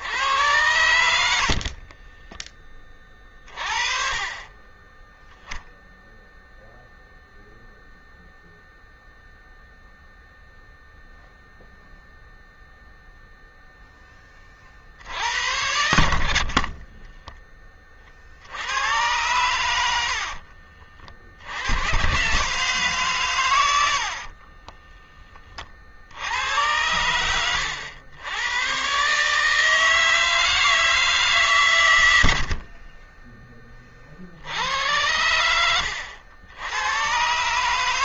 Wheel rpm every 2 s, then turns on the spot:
80, 20, 30, 0, 0, 0, 0, 30, 40, 70, 60, 140, 30, 80, 110, 160, 70, 70, 90.
16-18 20-22 24-26